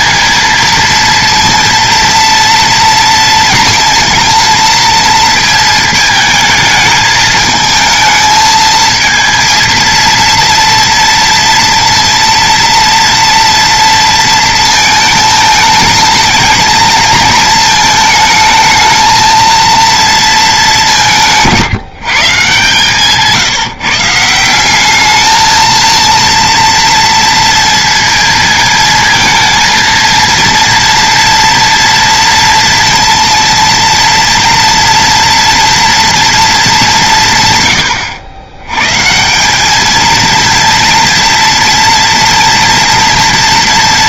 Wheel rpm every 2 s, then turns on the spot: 230, 230, 220, 220, 220, 230, 230, 230, 220, 220, 210, 150, 190, 230, 230, 230, 230, 230, 210, 110, 230, 230.
none